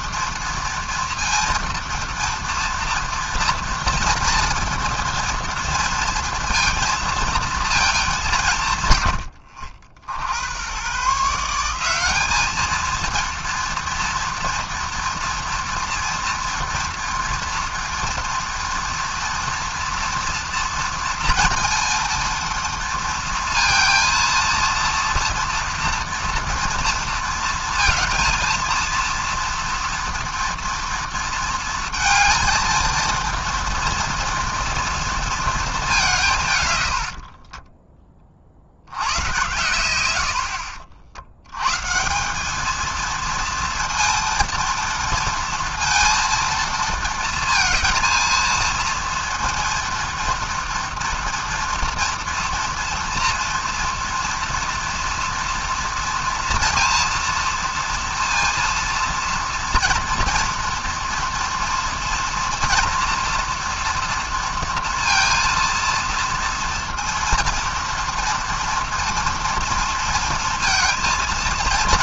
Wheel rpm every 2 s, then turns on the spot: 230, 230, 230, 230, 140, 110, 220, 230, 230, 230, 230, 230, 230, 230, 230, 230, 230, 230, 140, 60, 70, 210, 230, 220, 230, 230, 230, 230, 230, 230, 230, 230, 230, 230, 230, 230.
none